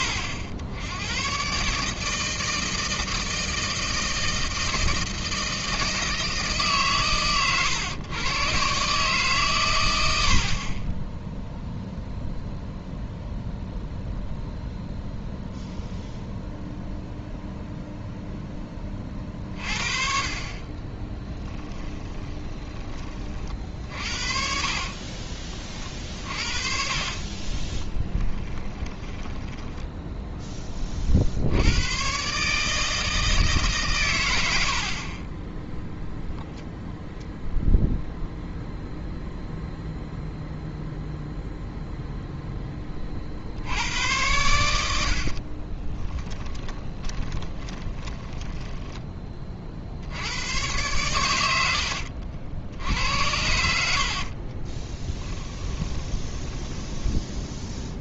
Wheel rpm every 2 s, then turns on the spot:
80, 160, 160, 150, 140, 20, 0, 0, 0, 20, 30, 20, 50, 40, 10, 30, 150, 60, 0, 0, 0, 20, 90, 20, 10, 110, 70, 30, 10.
20-30 46-48 54-58